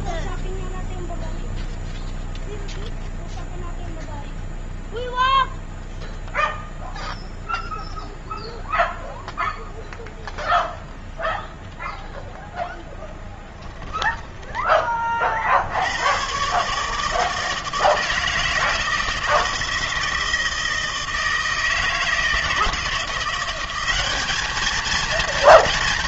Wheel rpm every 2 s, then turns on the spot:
0, 0, 0, 0, 0, 0, 0, 10, 120, 160, 160, 160, 210.
14-16